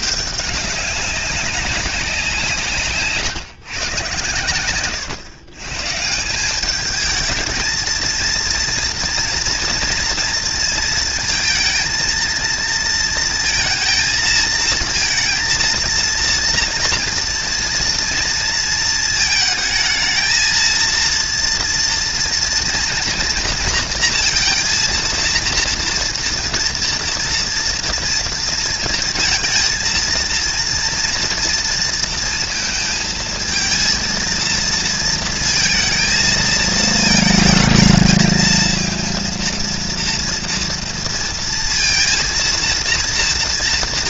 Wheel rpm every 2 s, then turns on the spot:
200, 150, 120, 210, 230, 230, 230, 230, 230, 220, 230, 230, 230, 230, 230, 230, 220, 230, 220, 230, 230, 230.
4-6